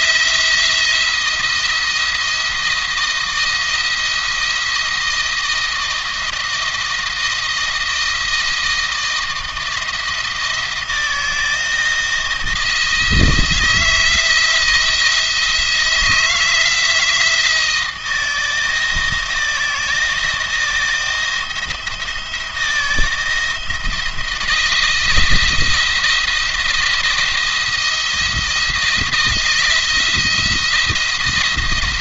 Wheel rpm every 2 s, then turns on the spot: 170, 170, 170, 160, 160, 170, 160, 160, 170, 160, 160, 170, 170, 170, 170, 170.
none